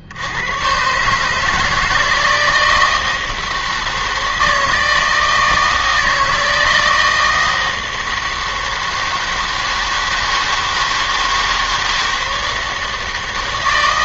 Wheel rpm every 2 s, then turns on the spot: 120, 160, 160, 160, 160, 160, 160.
none